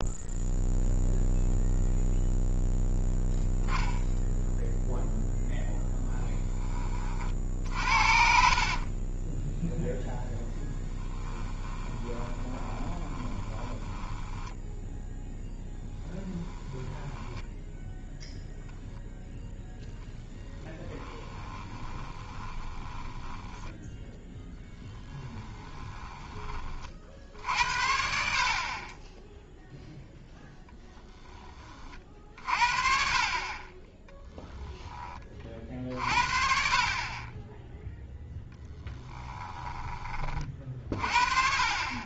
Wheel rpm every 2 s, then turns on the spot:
0, 0, 0, 30, 30, 20, 20, 10, 0, 0, 10, 10, 10, 50, 20, 0, 50, 10, 50, 10, 50.
8-14 20-26 34-36 38-40